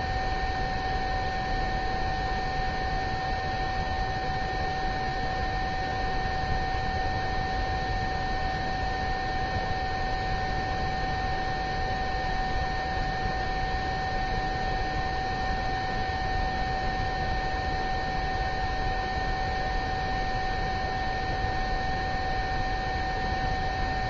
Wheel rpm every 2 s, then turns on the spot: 0, 0, 0, 0, 0, 0, 0, 0, 0, 0, 0, 0.
none